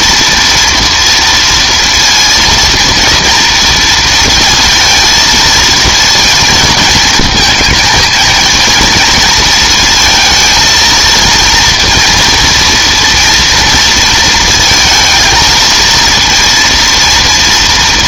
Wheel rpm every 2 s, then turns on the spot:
240, 230, 230, 220, 220, 220, 230, 230, 230.
none